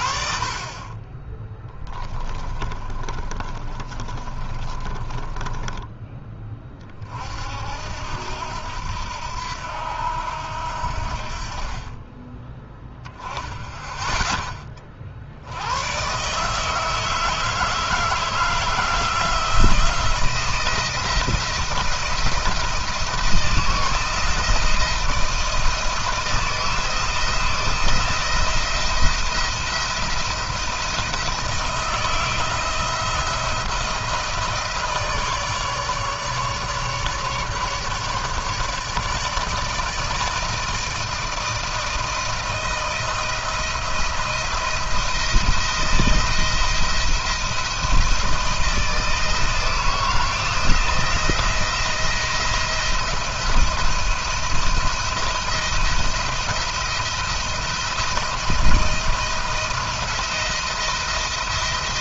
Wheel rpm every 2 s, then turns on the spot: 30, 20, 30, 40, 80, 70, 10, 20, 150, 160, 170, 160, 160, 160, 170, 170, 170, 160, 150, 150, 160, 160, 170, 170, 160, 170, 170, 170, 160, 170, 170.
2-6